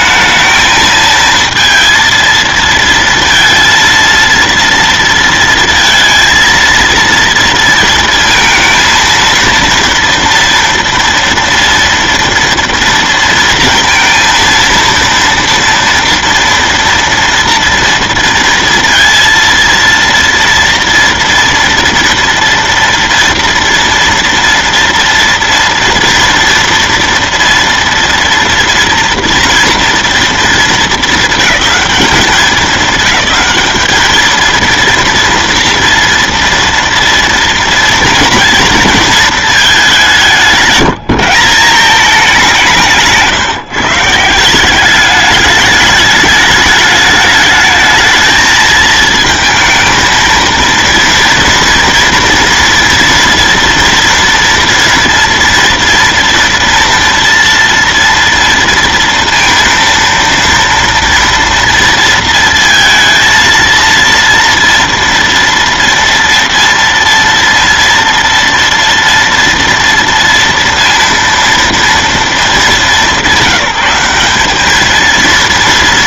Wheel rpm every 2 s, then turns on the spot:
220, 230, 230, 230, 230, 230, 230, 230, 230, 230, 230, 240, 230, 230, 230, 220, 220, 230, 230, 230, 180, 170, 190, 210, 220, 230, 230, 230, 230, 230, 230, 230, 230, 230, 240, 230, 200, 220.
none